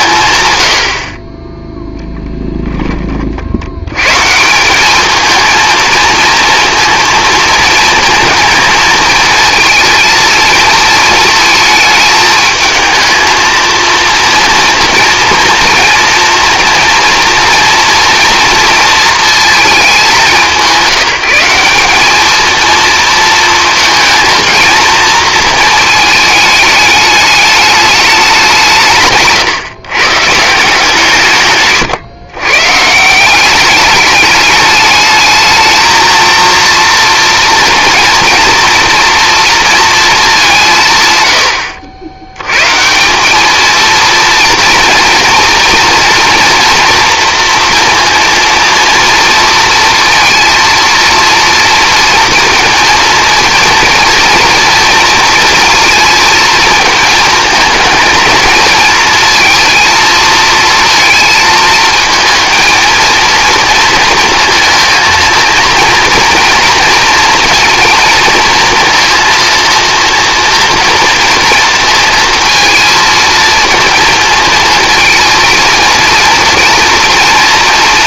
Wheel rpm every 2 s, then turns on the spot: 80, 10, 190, 230, 230, 220, 220, 230, 230, 230, 180, 230, 230, 210, 160, 160, 150, 210, 230, 230, 150, 160, 230, 230, 230, 230, 230, 240, 230, 230, 220, 230, 230, 230, 230, 230, 230, 230, 230.
none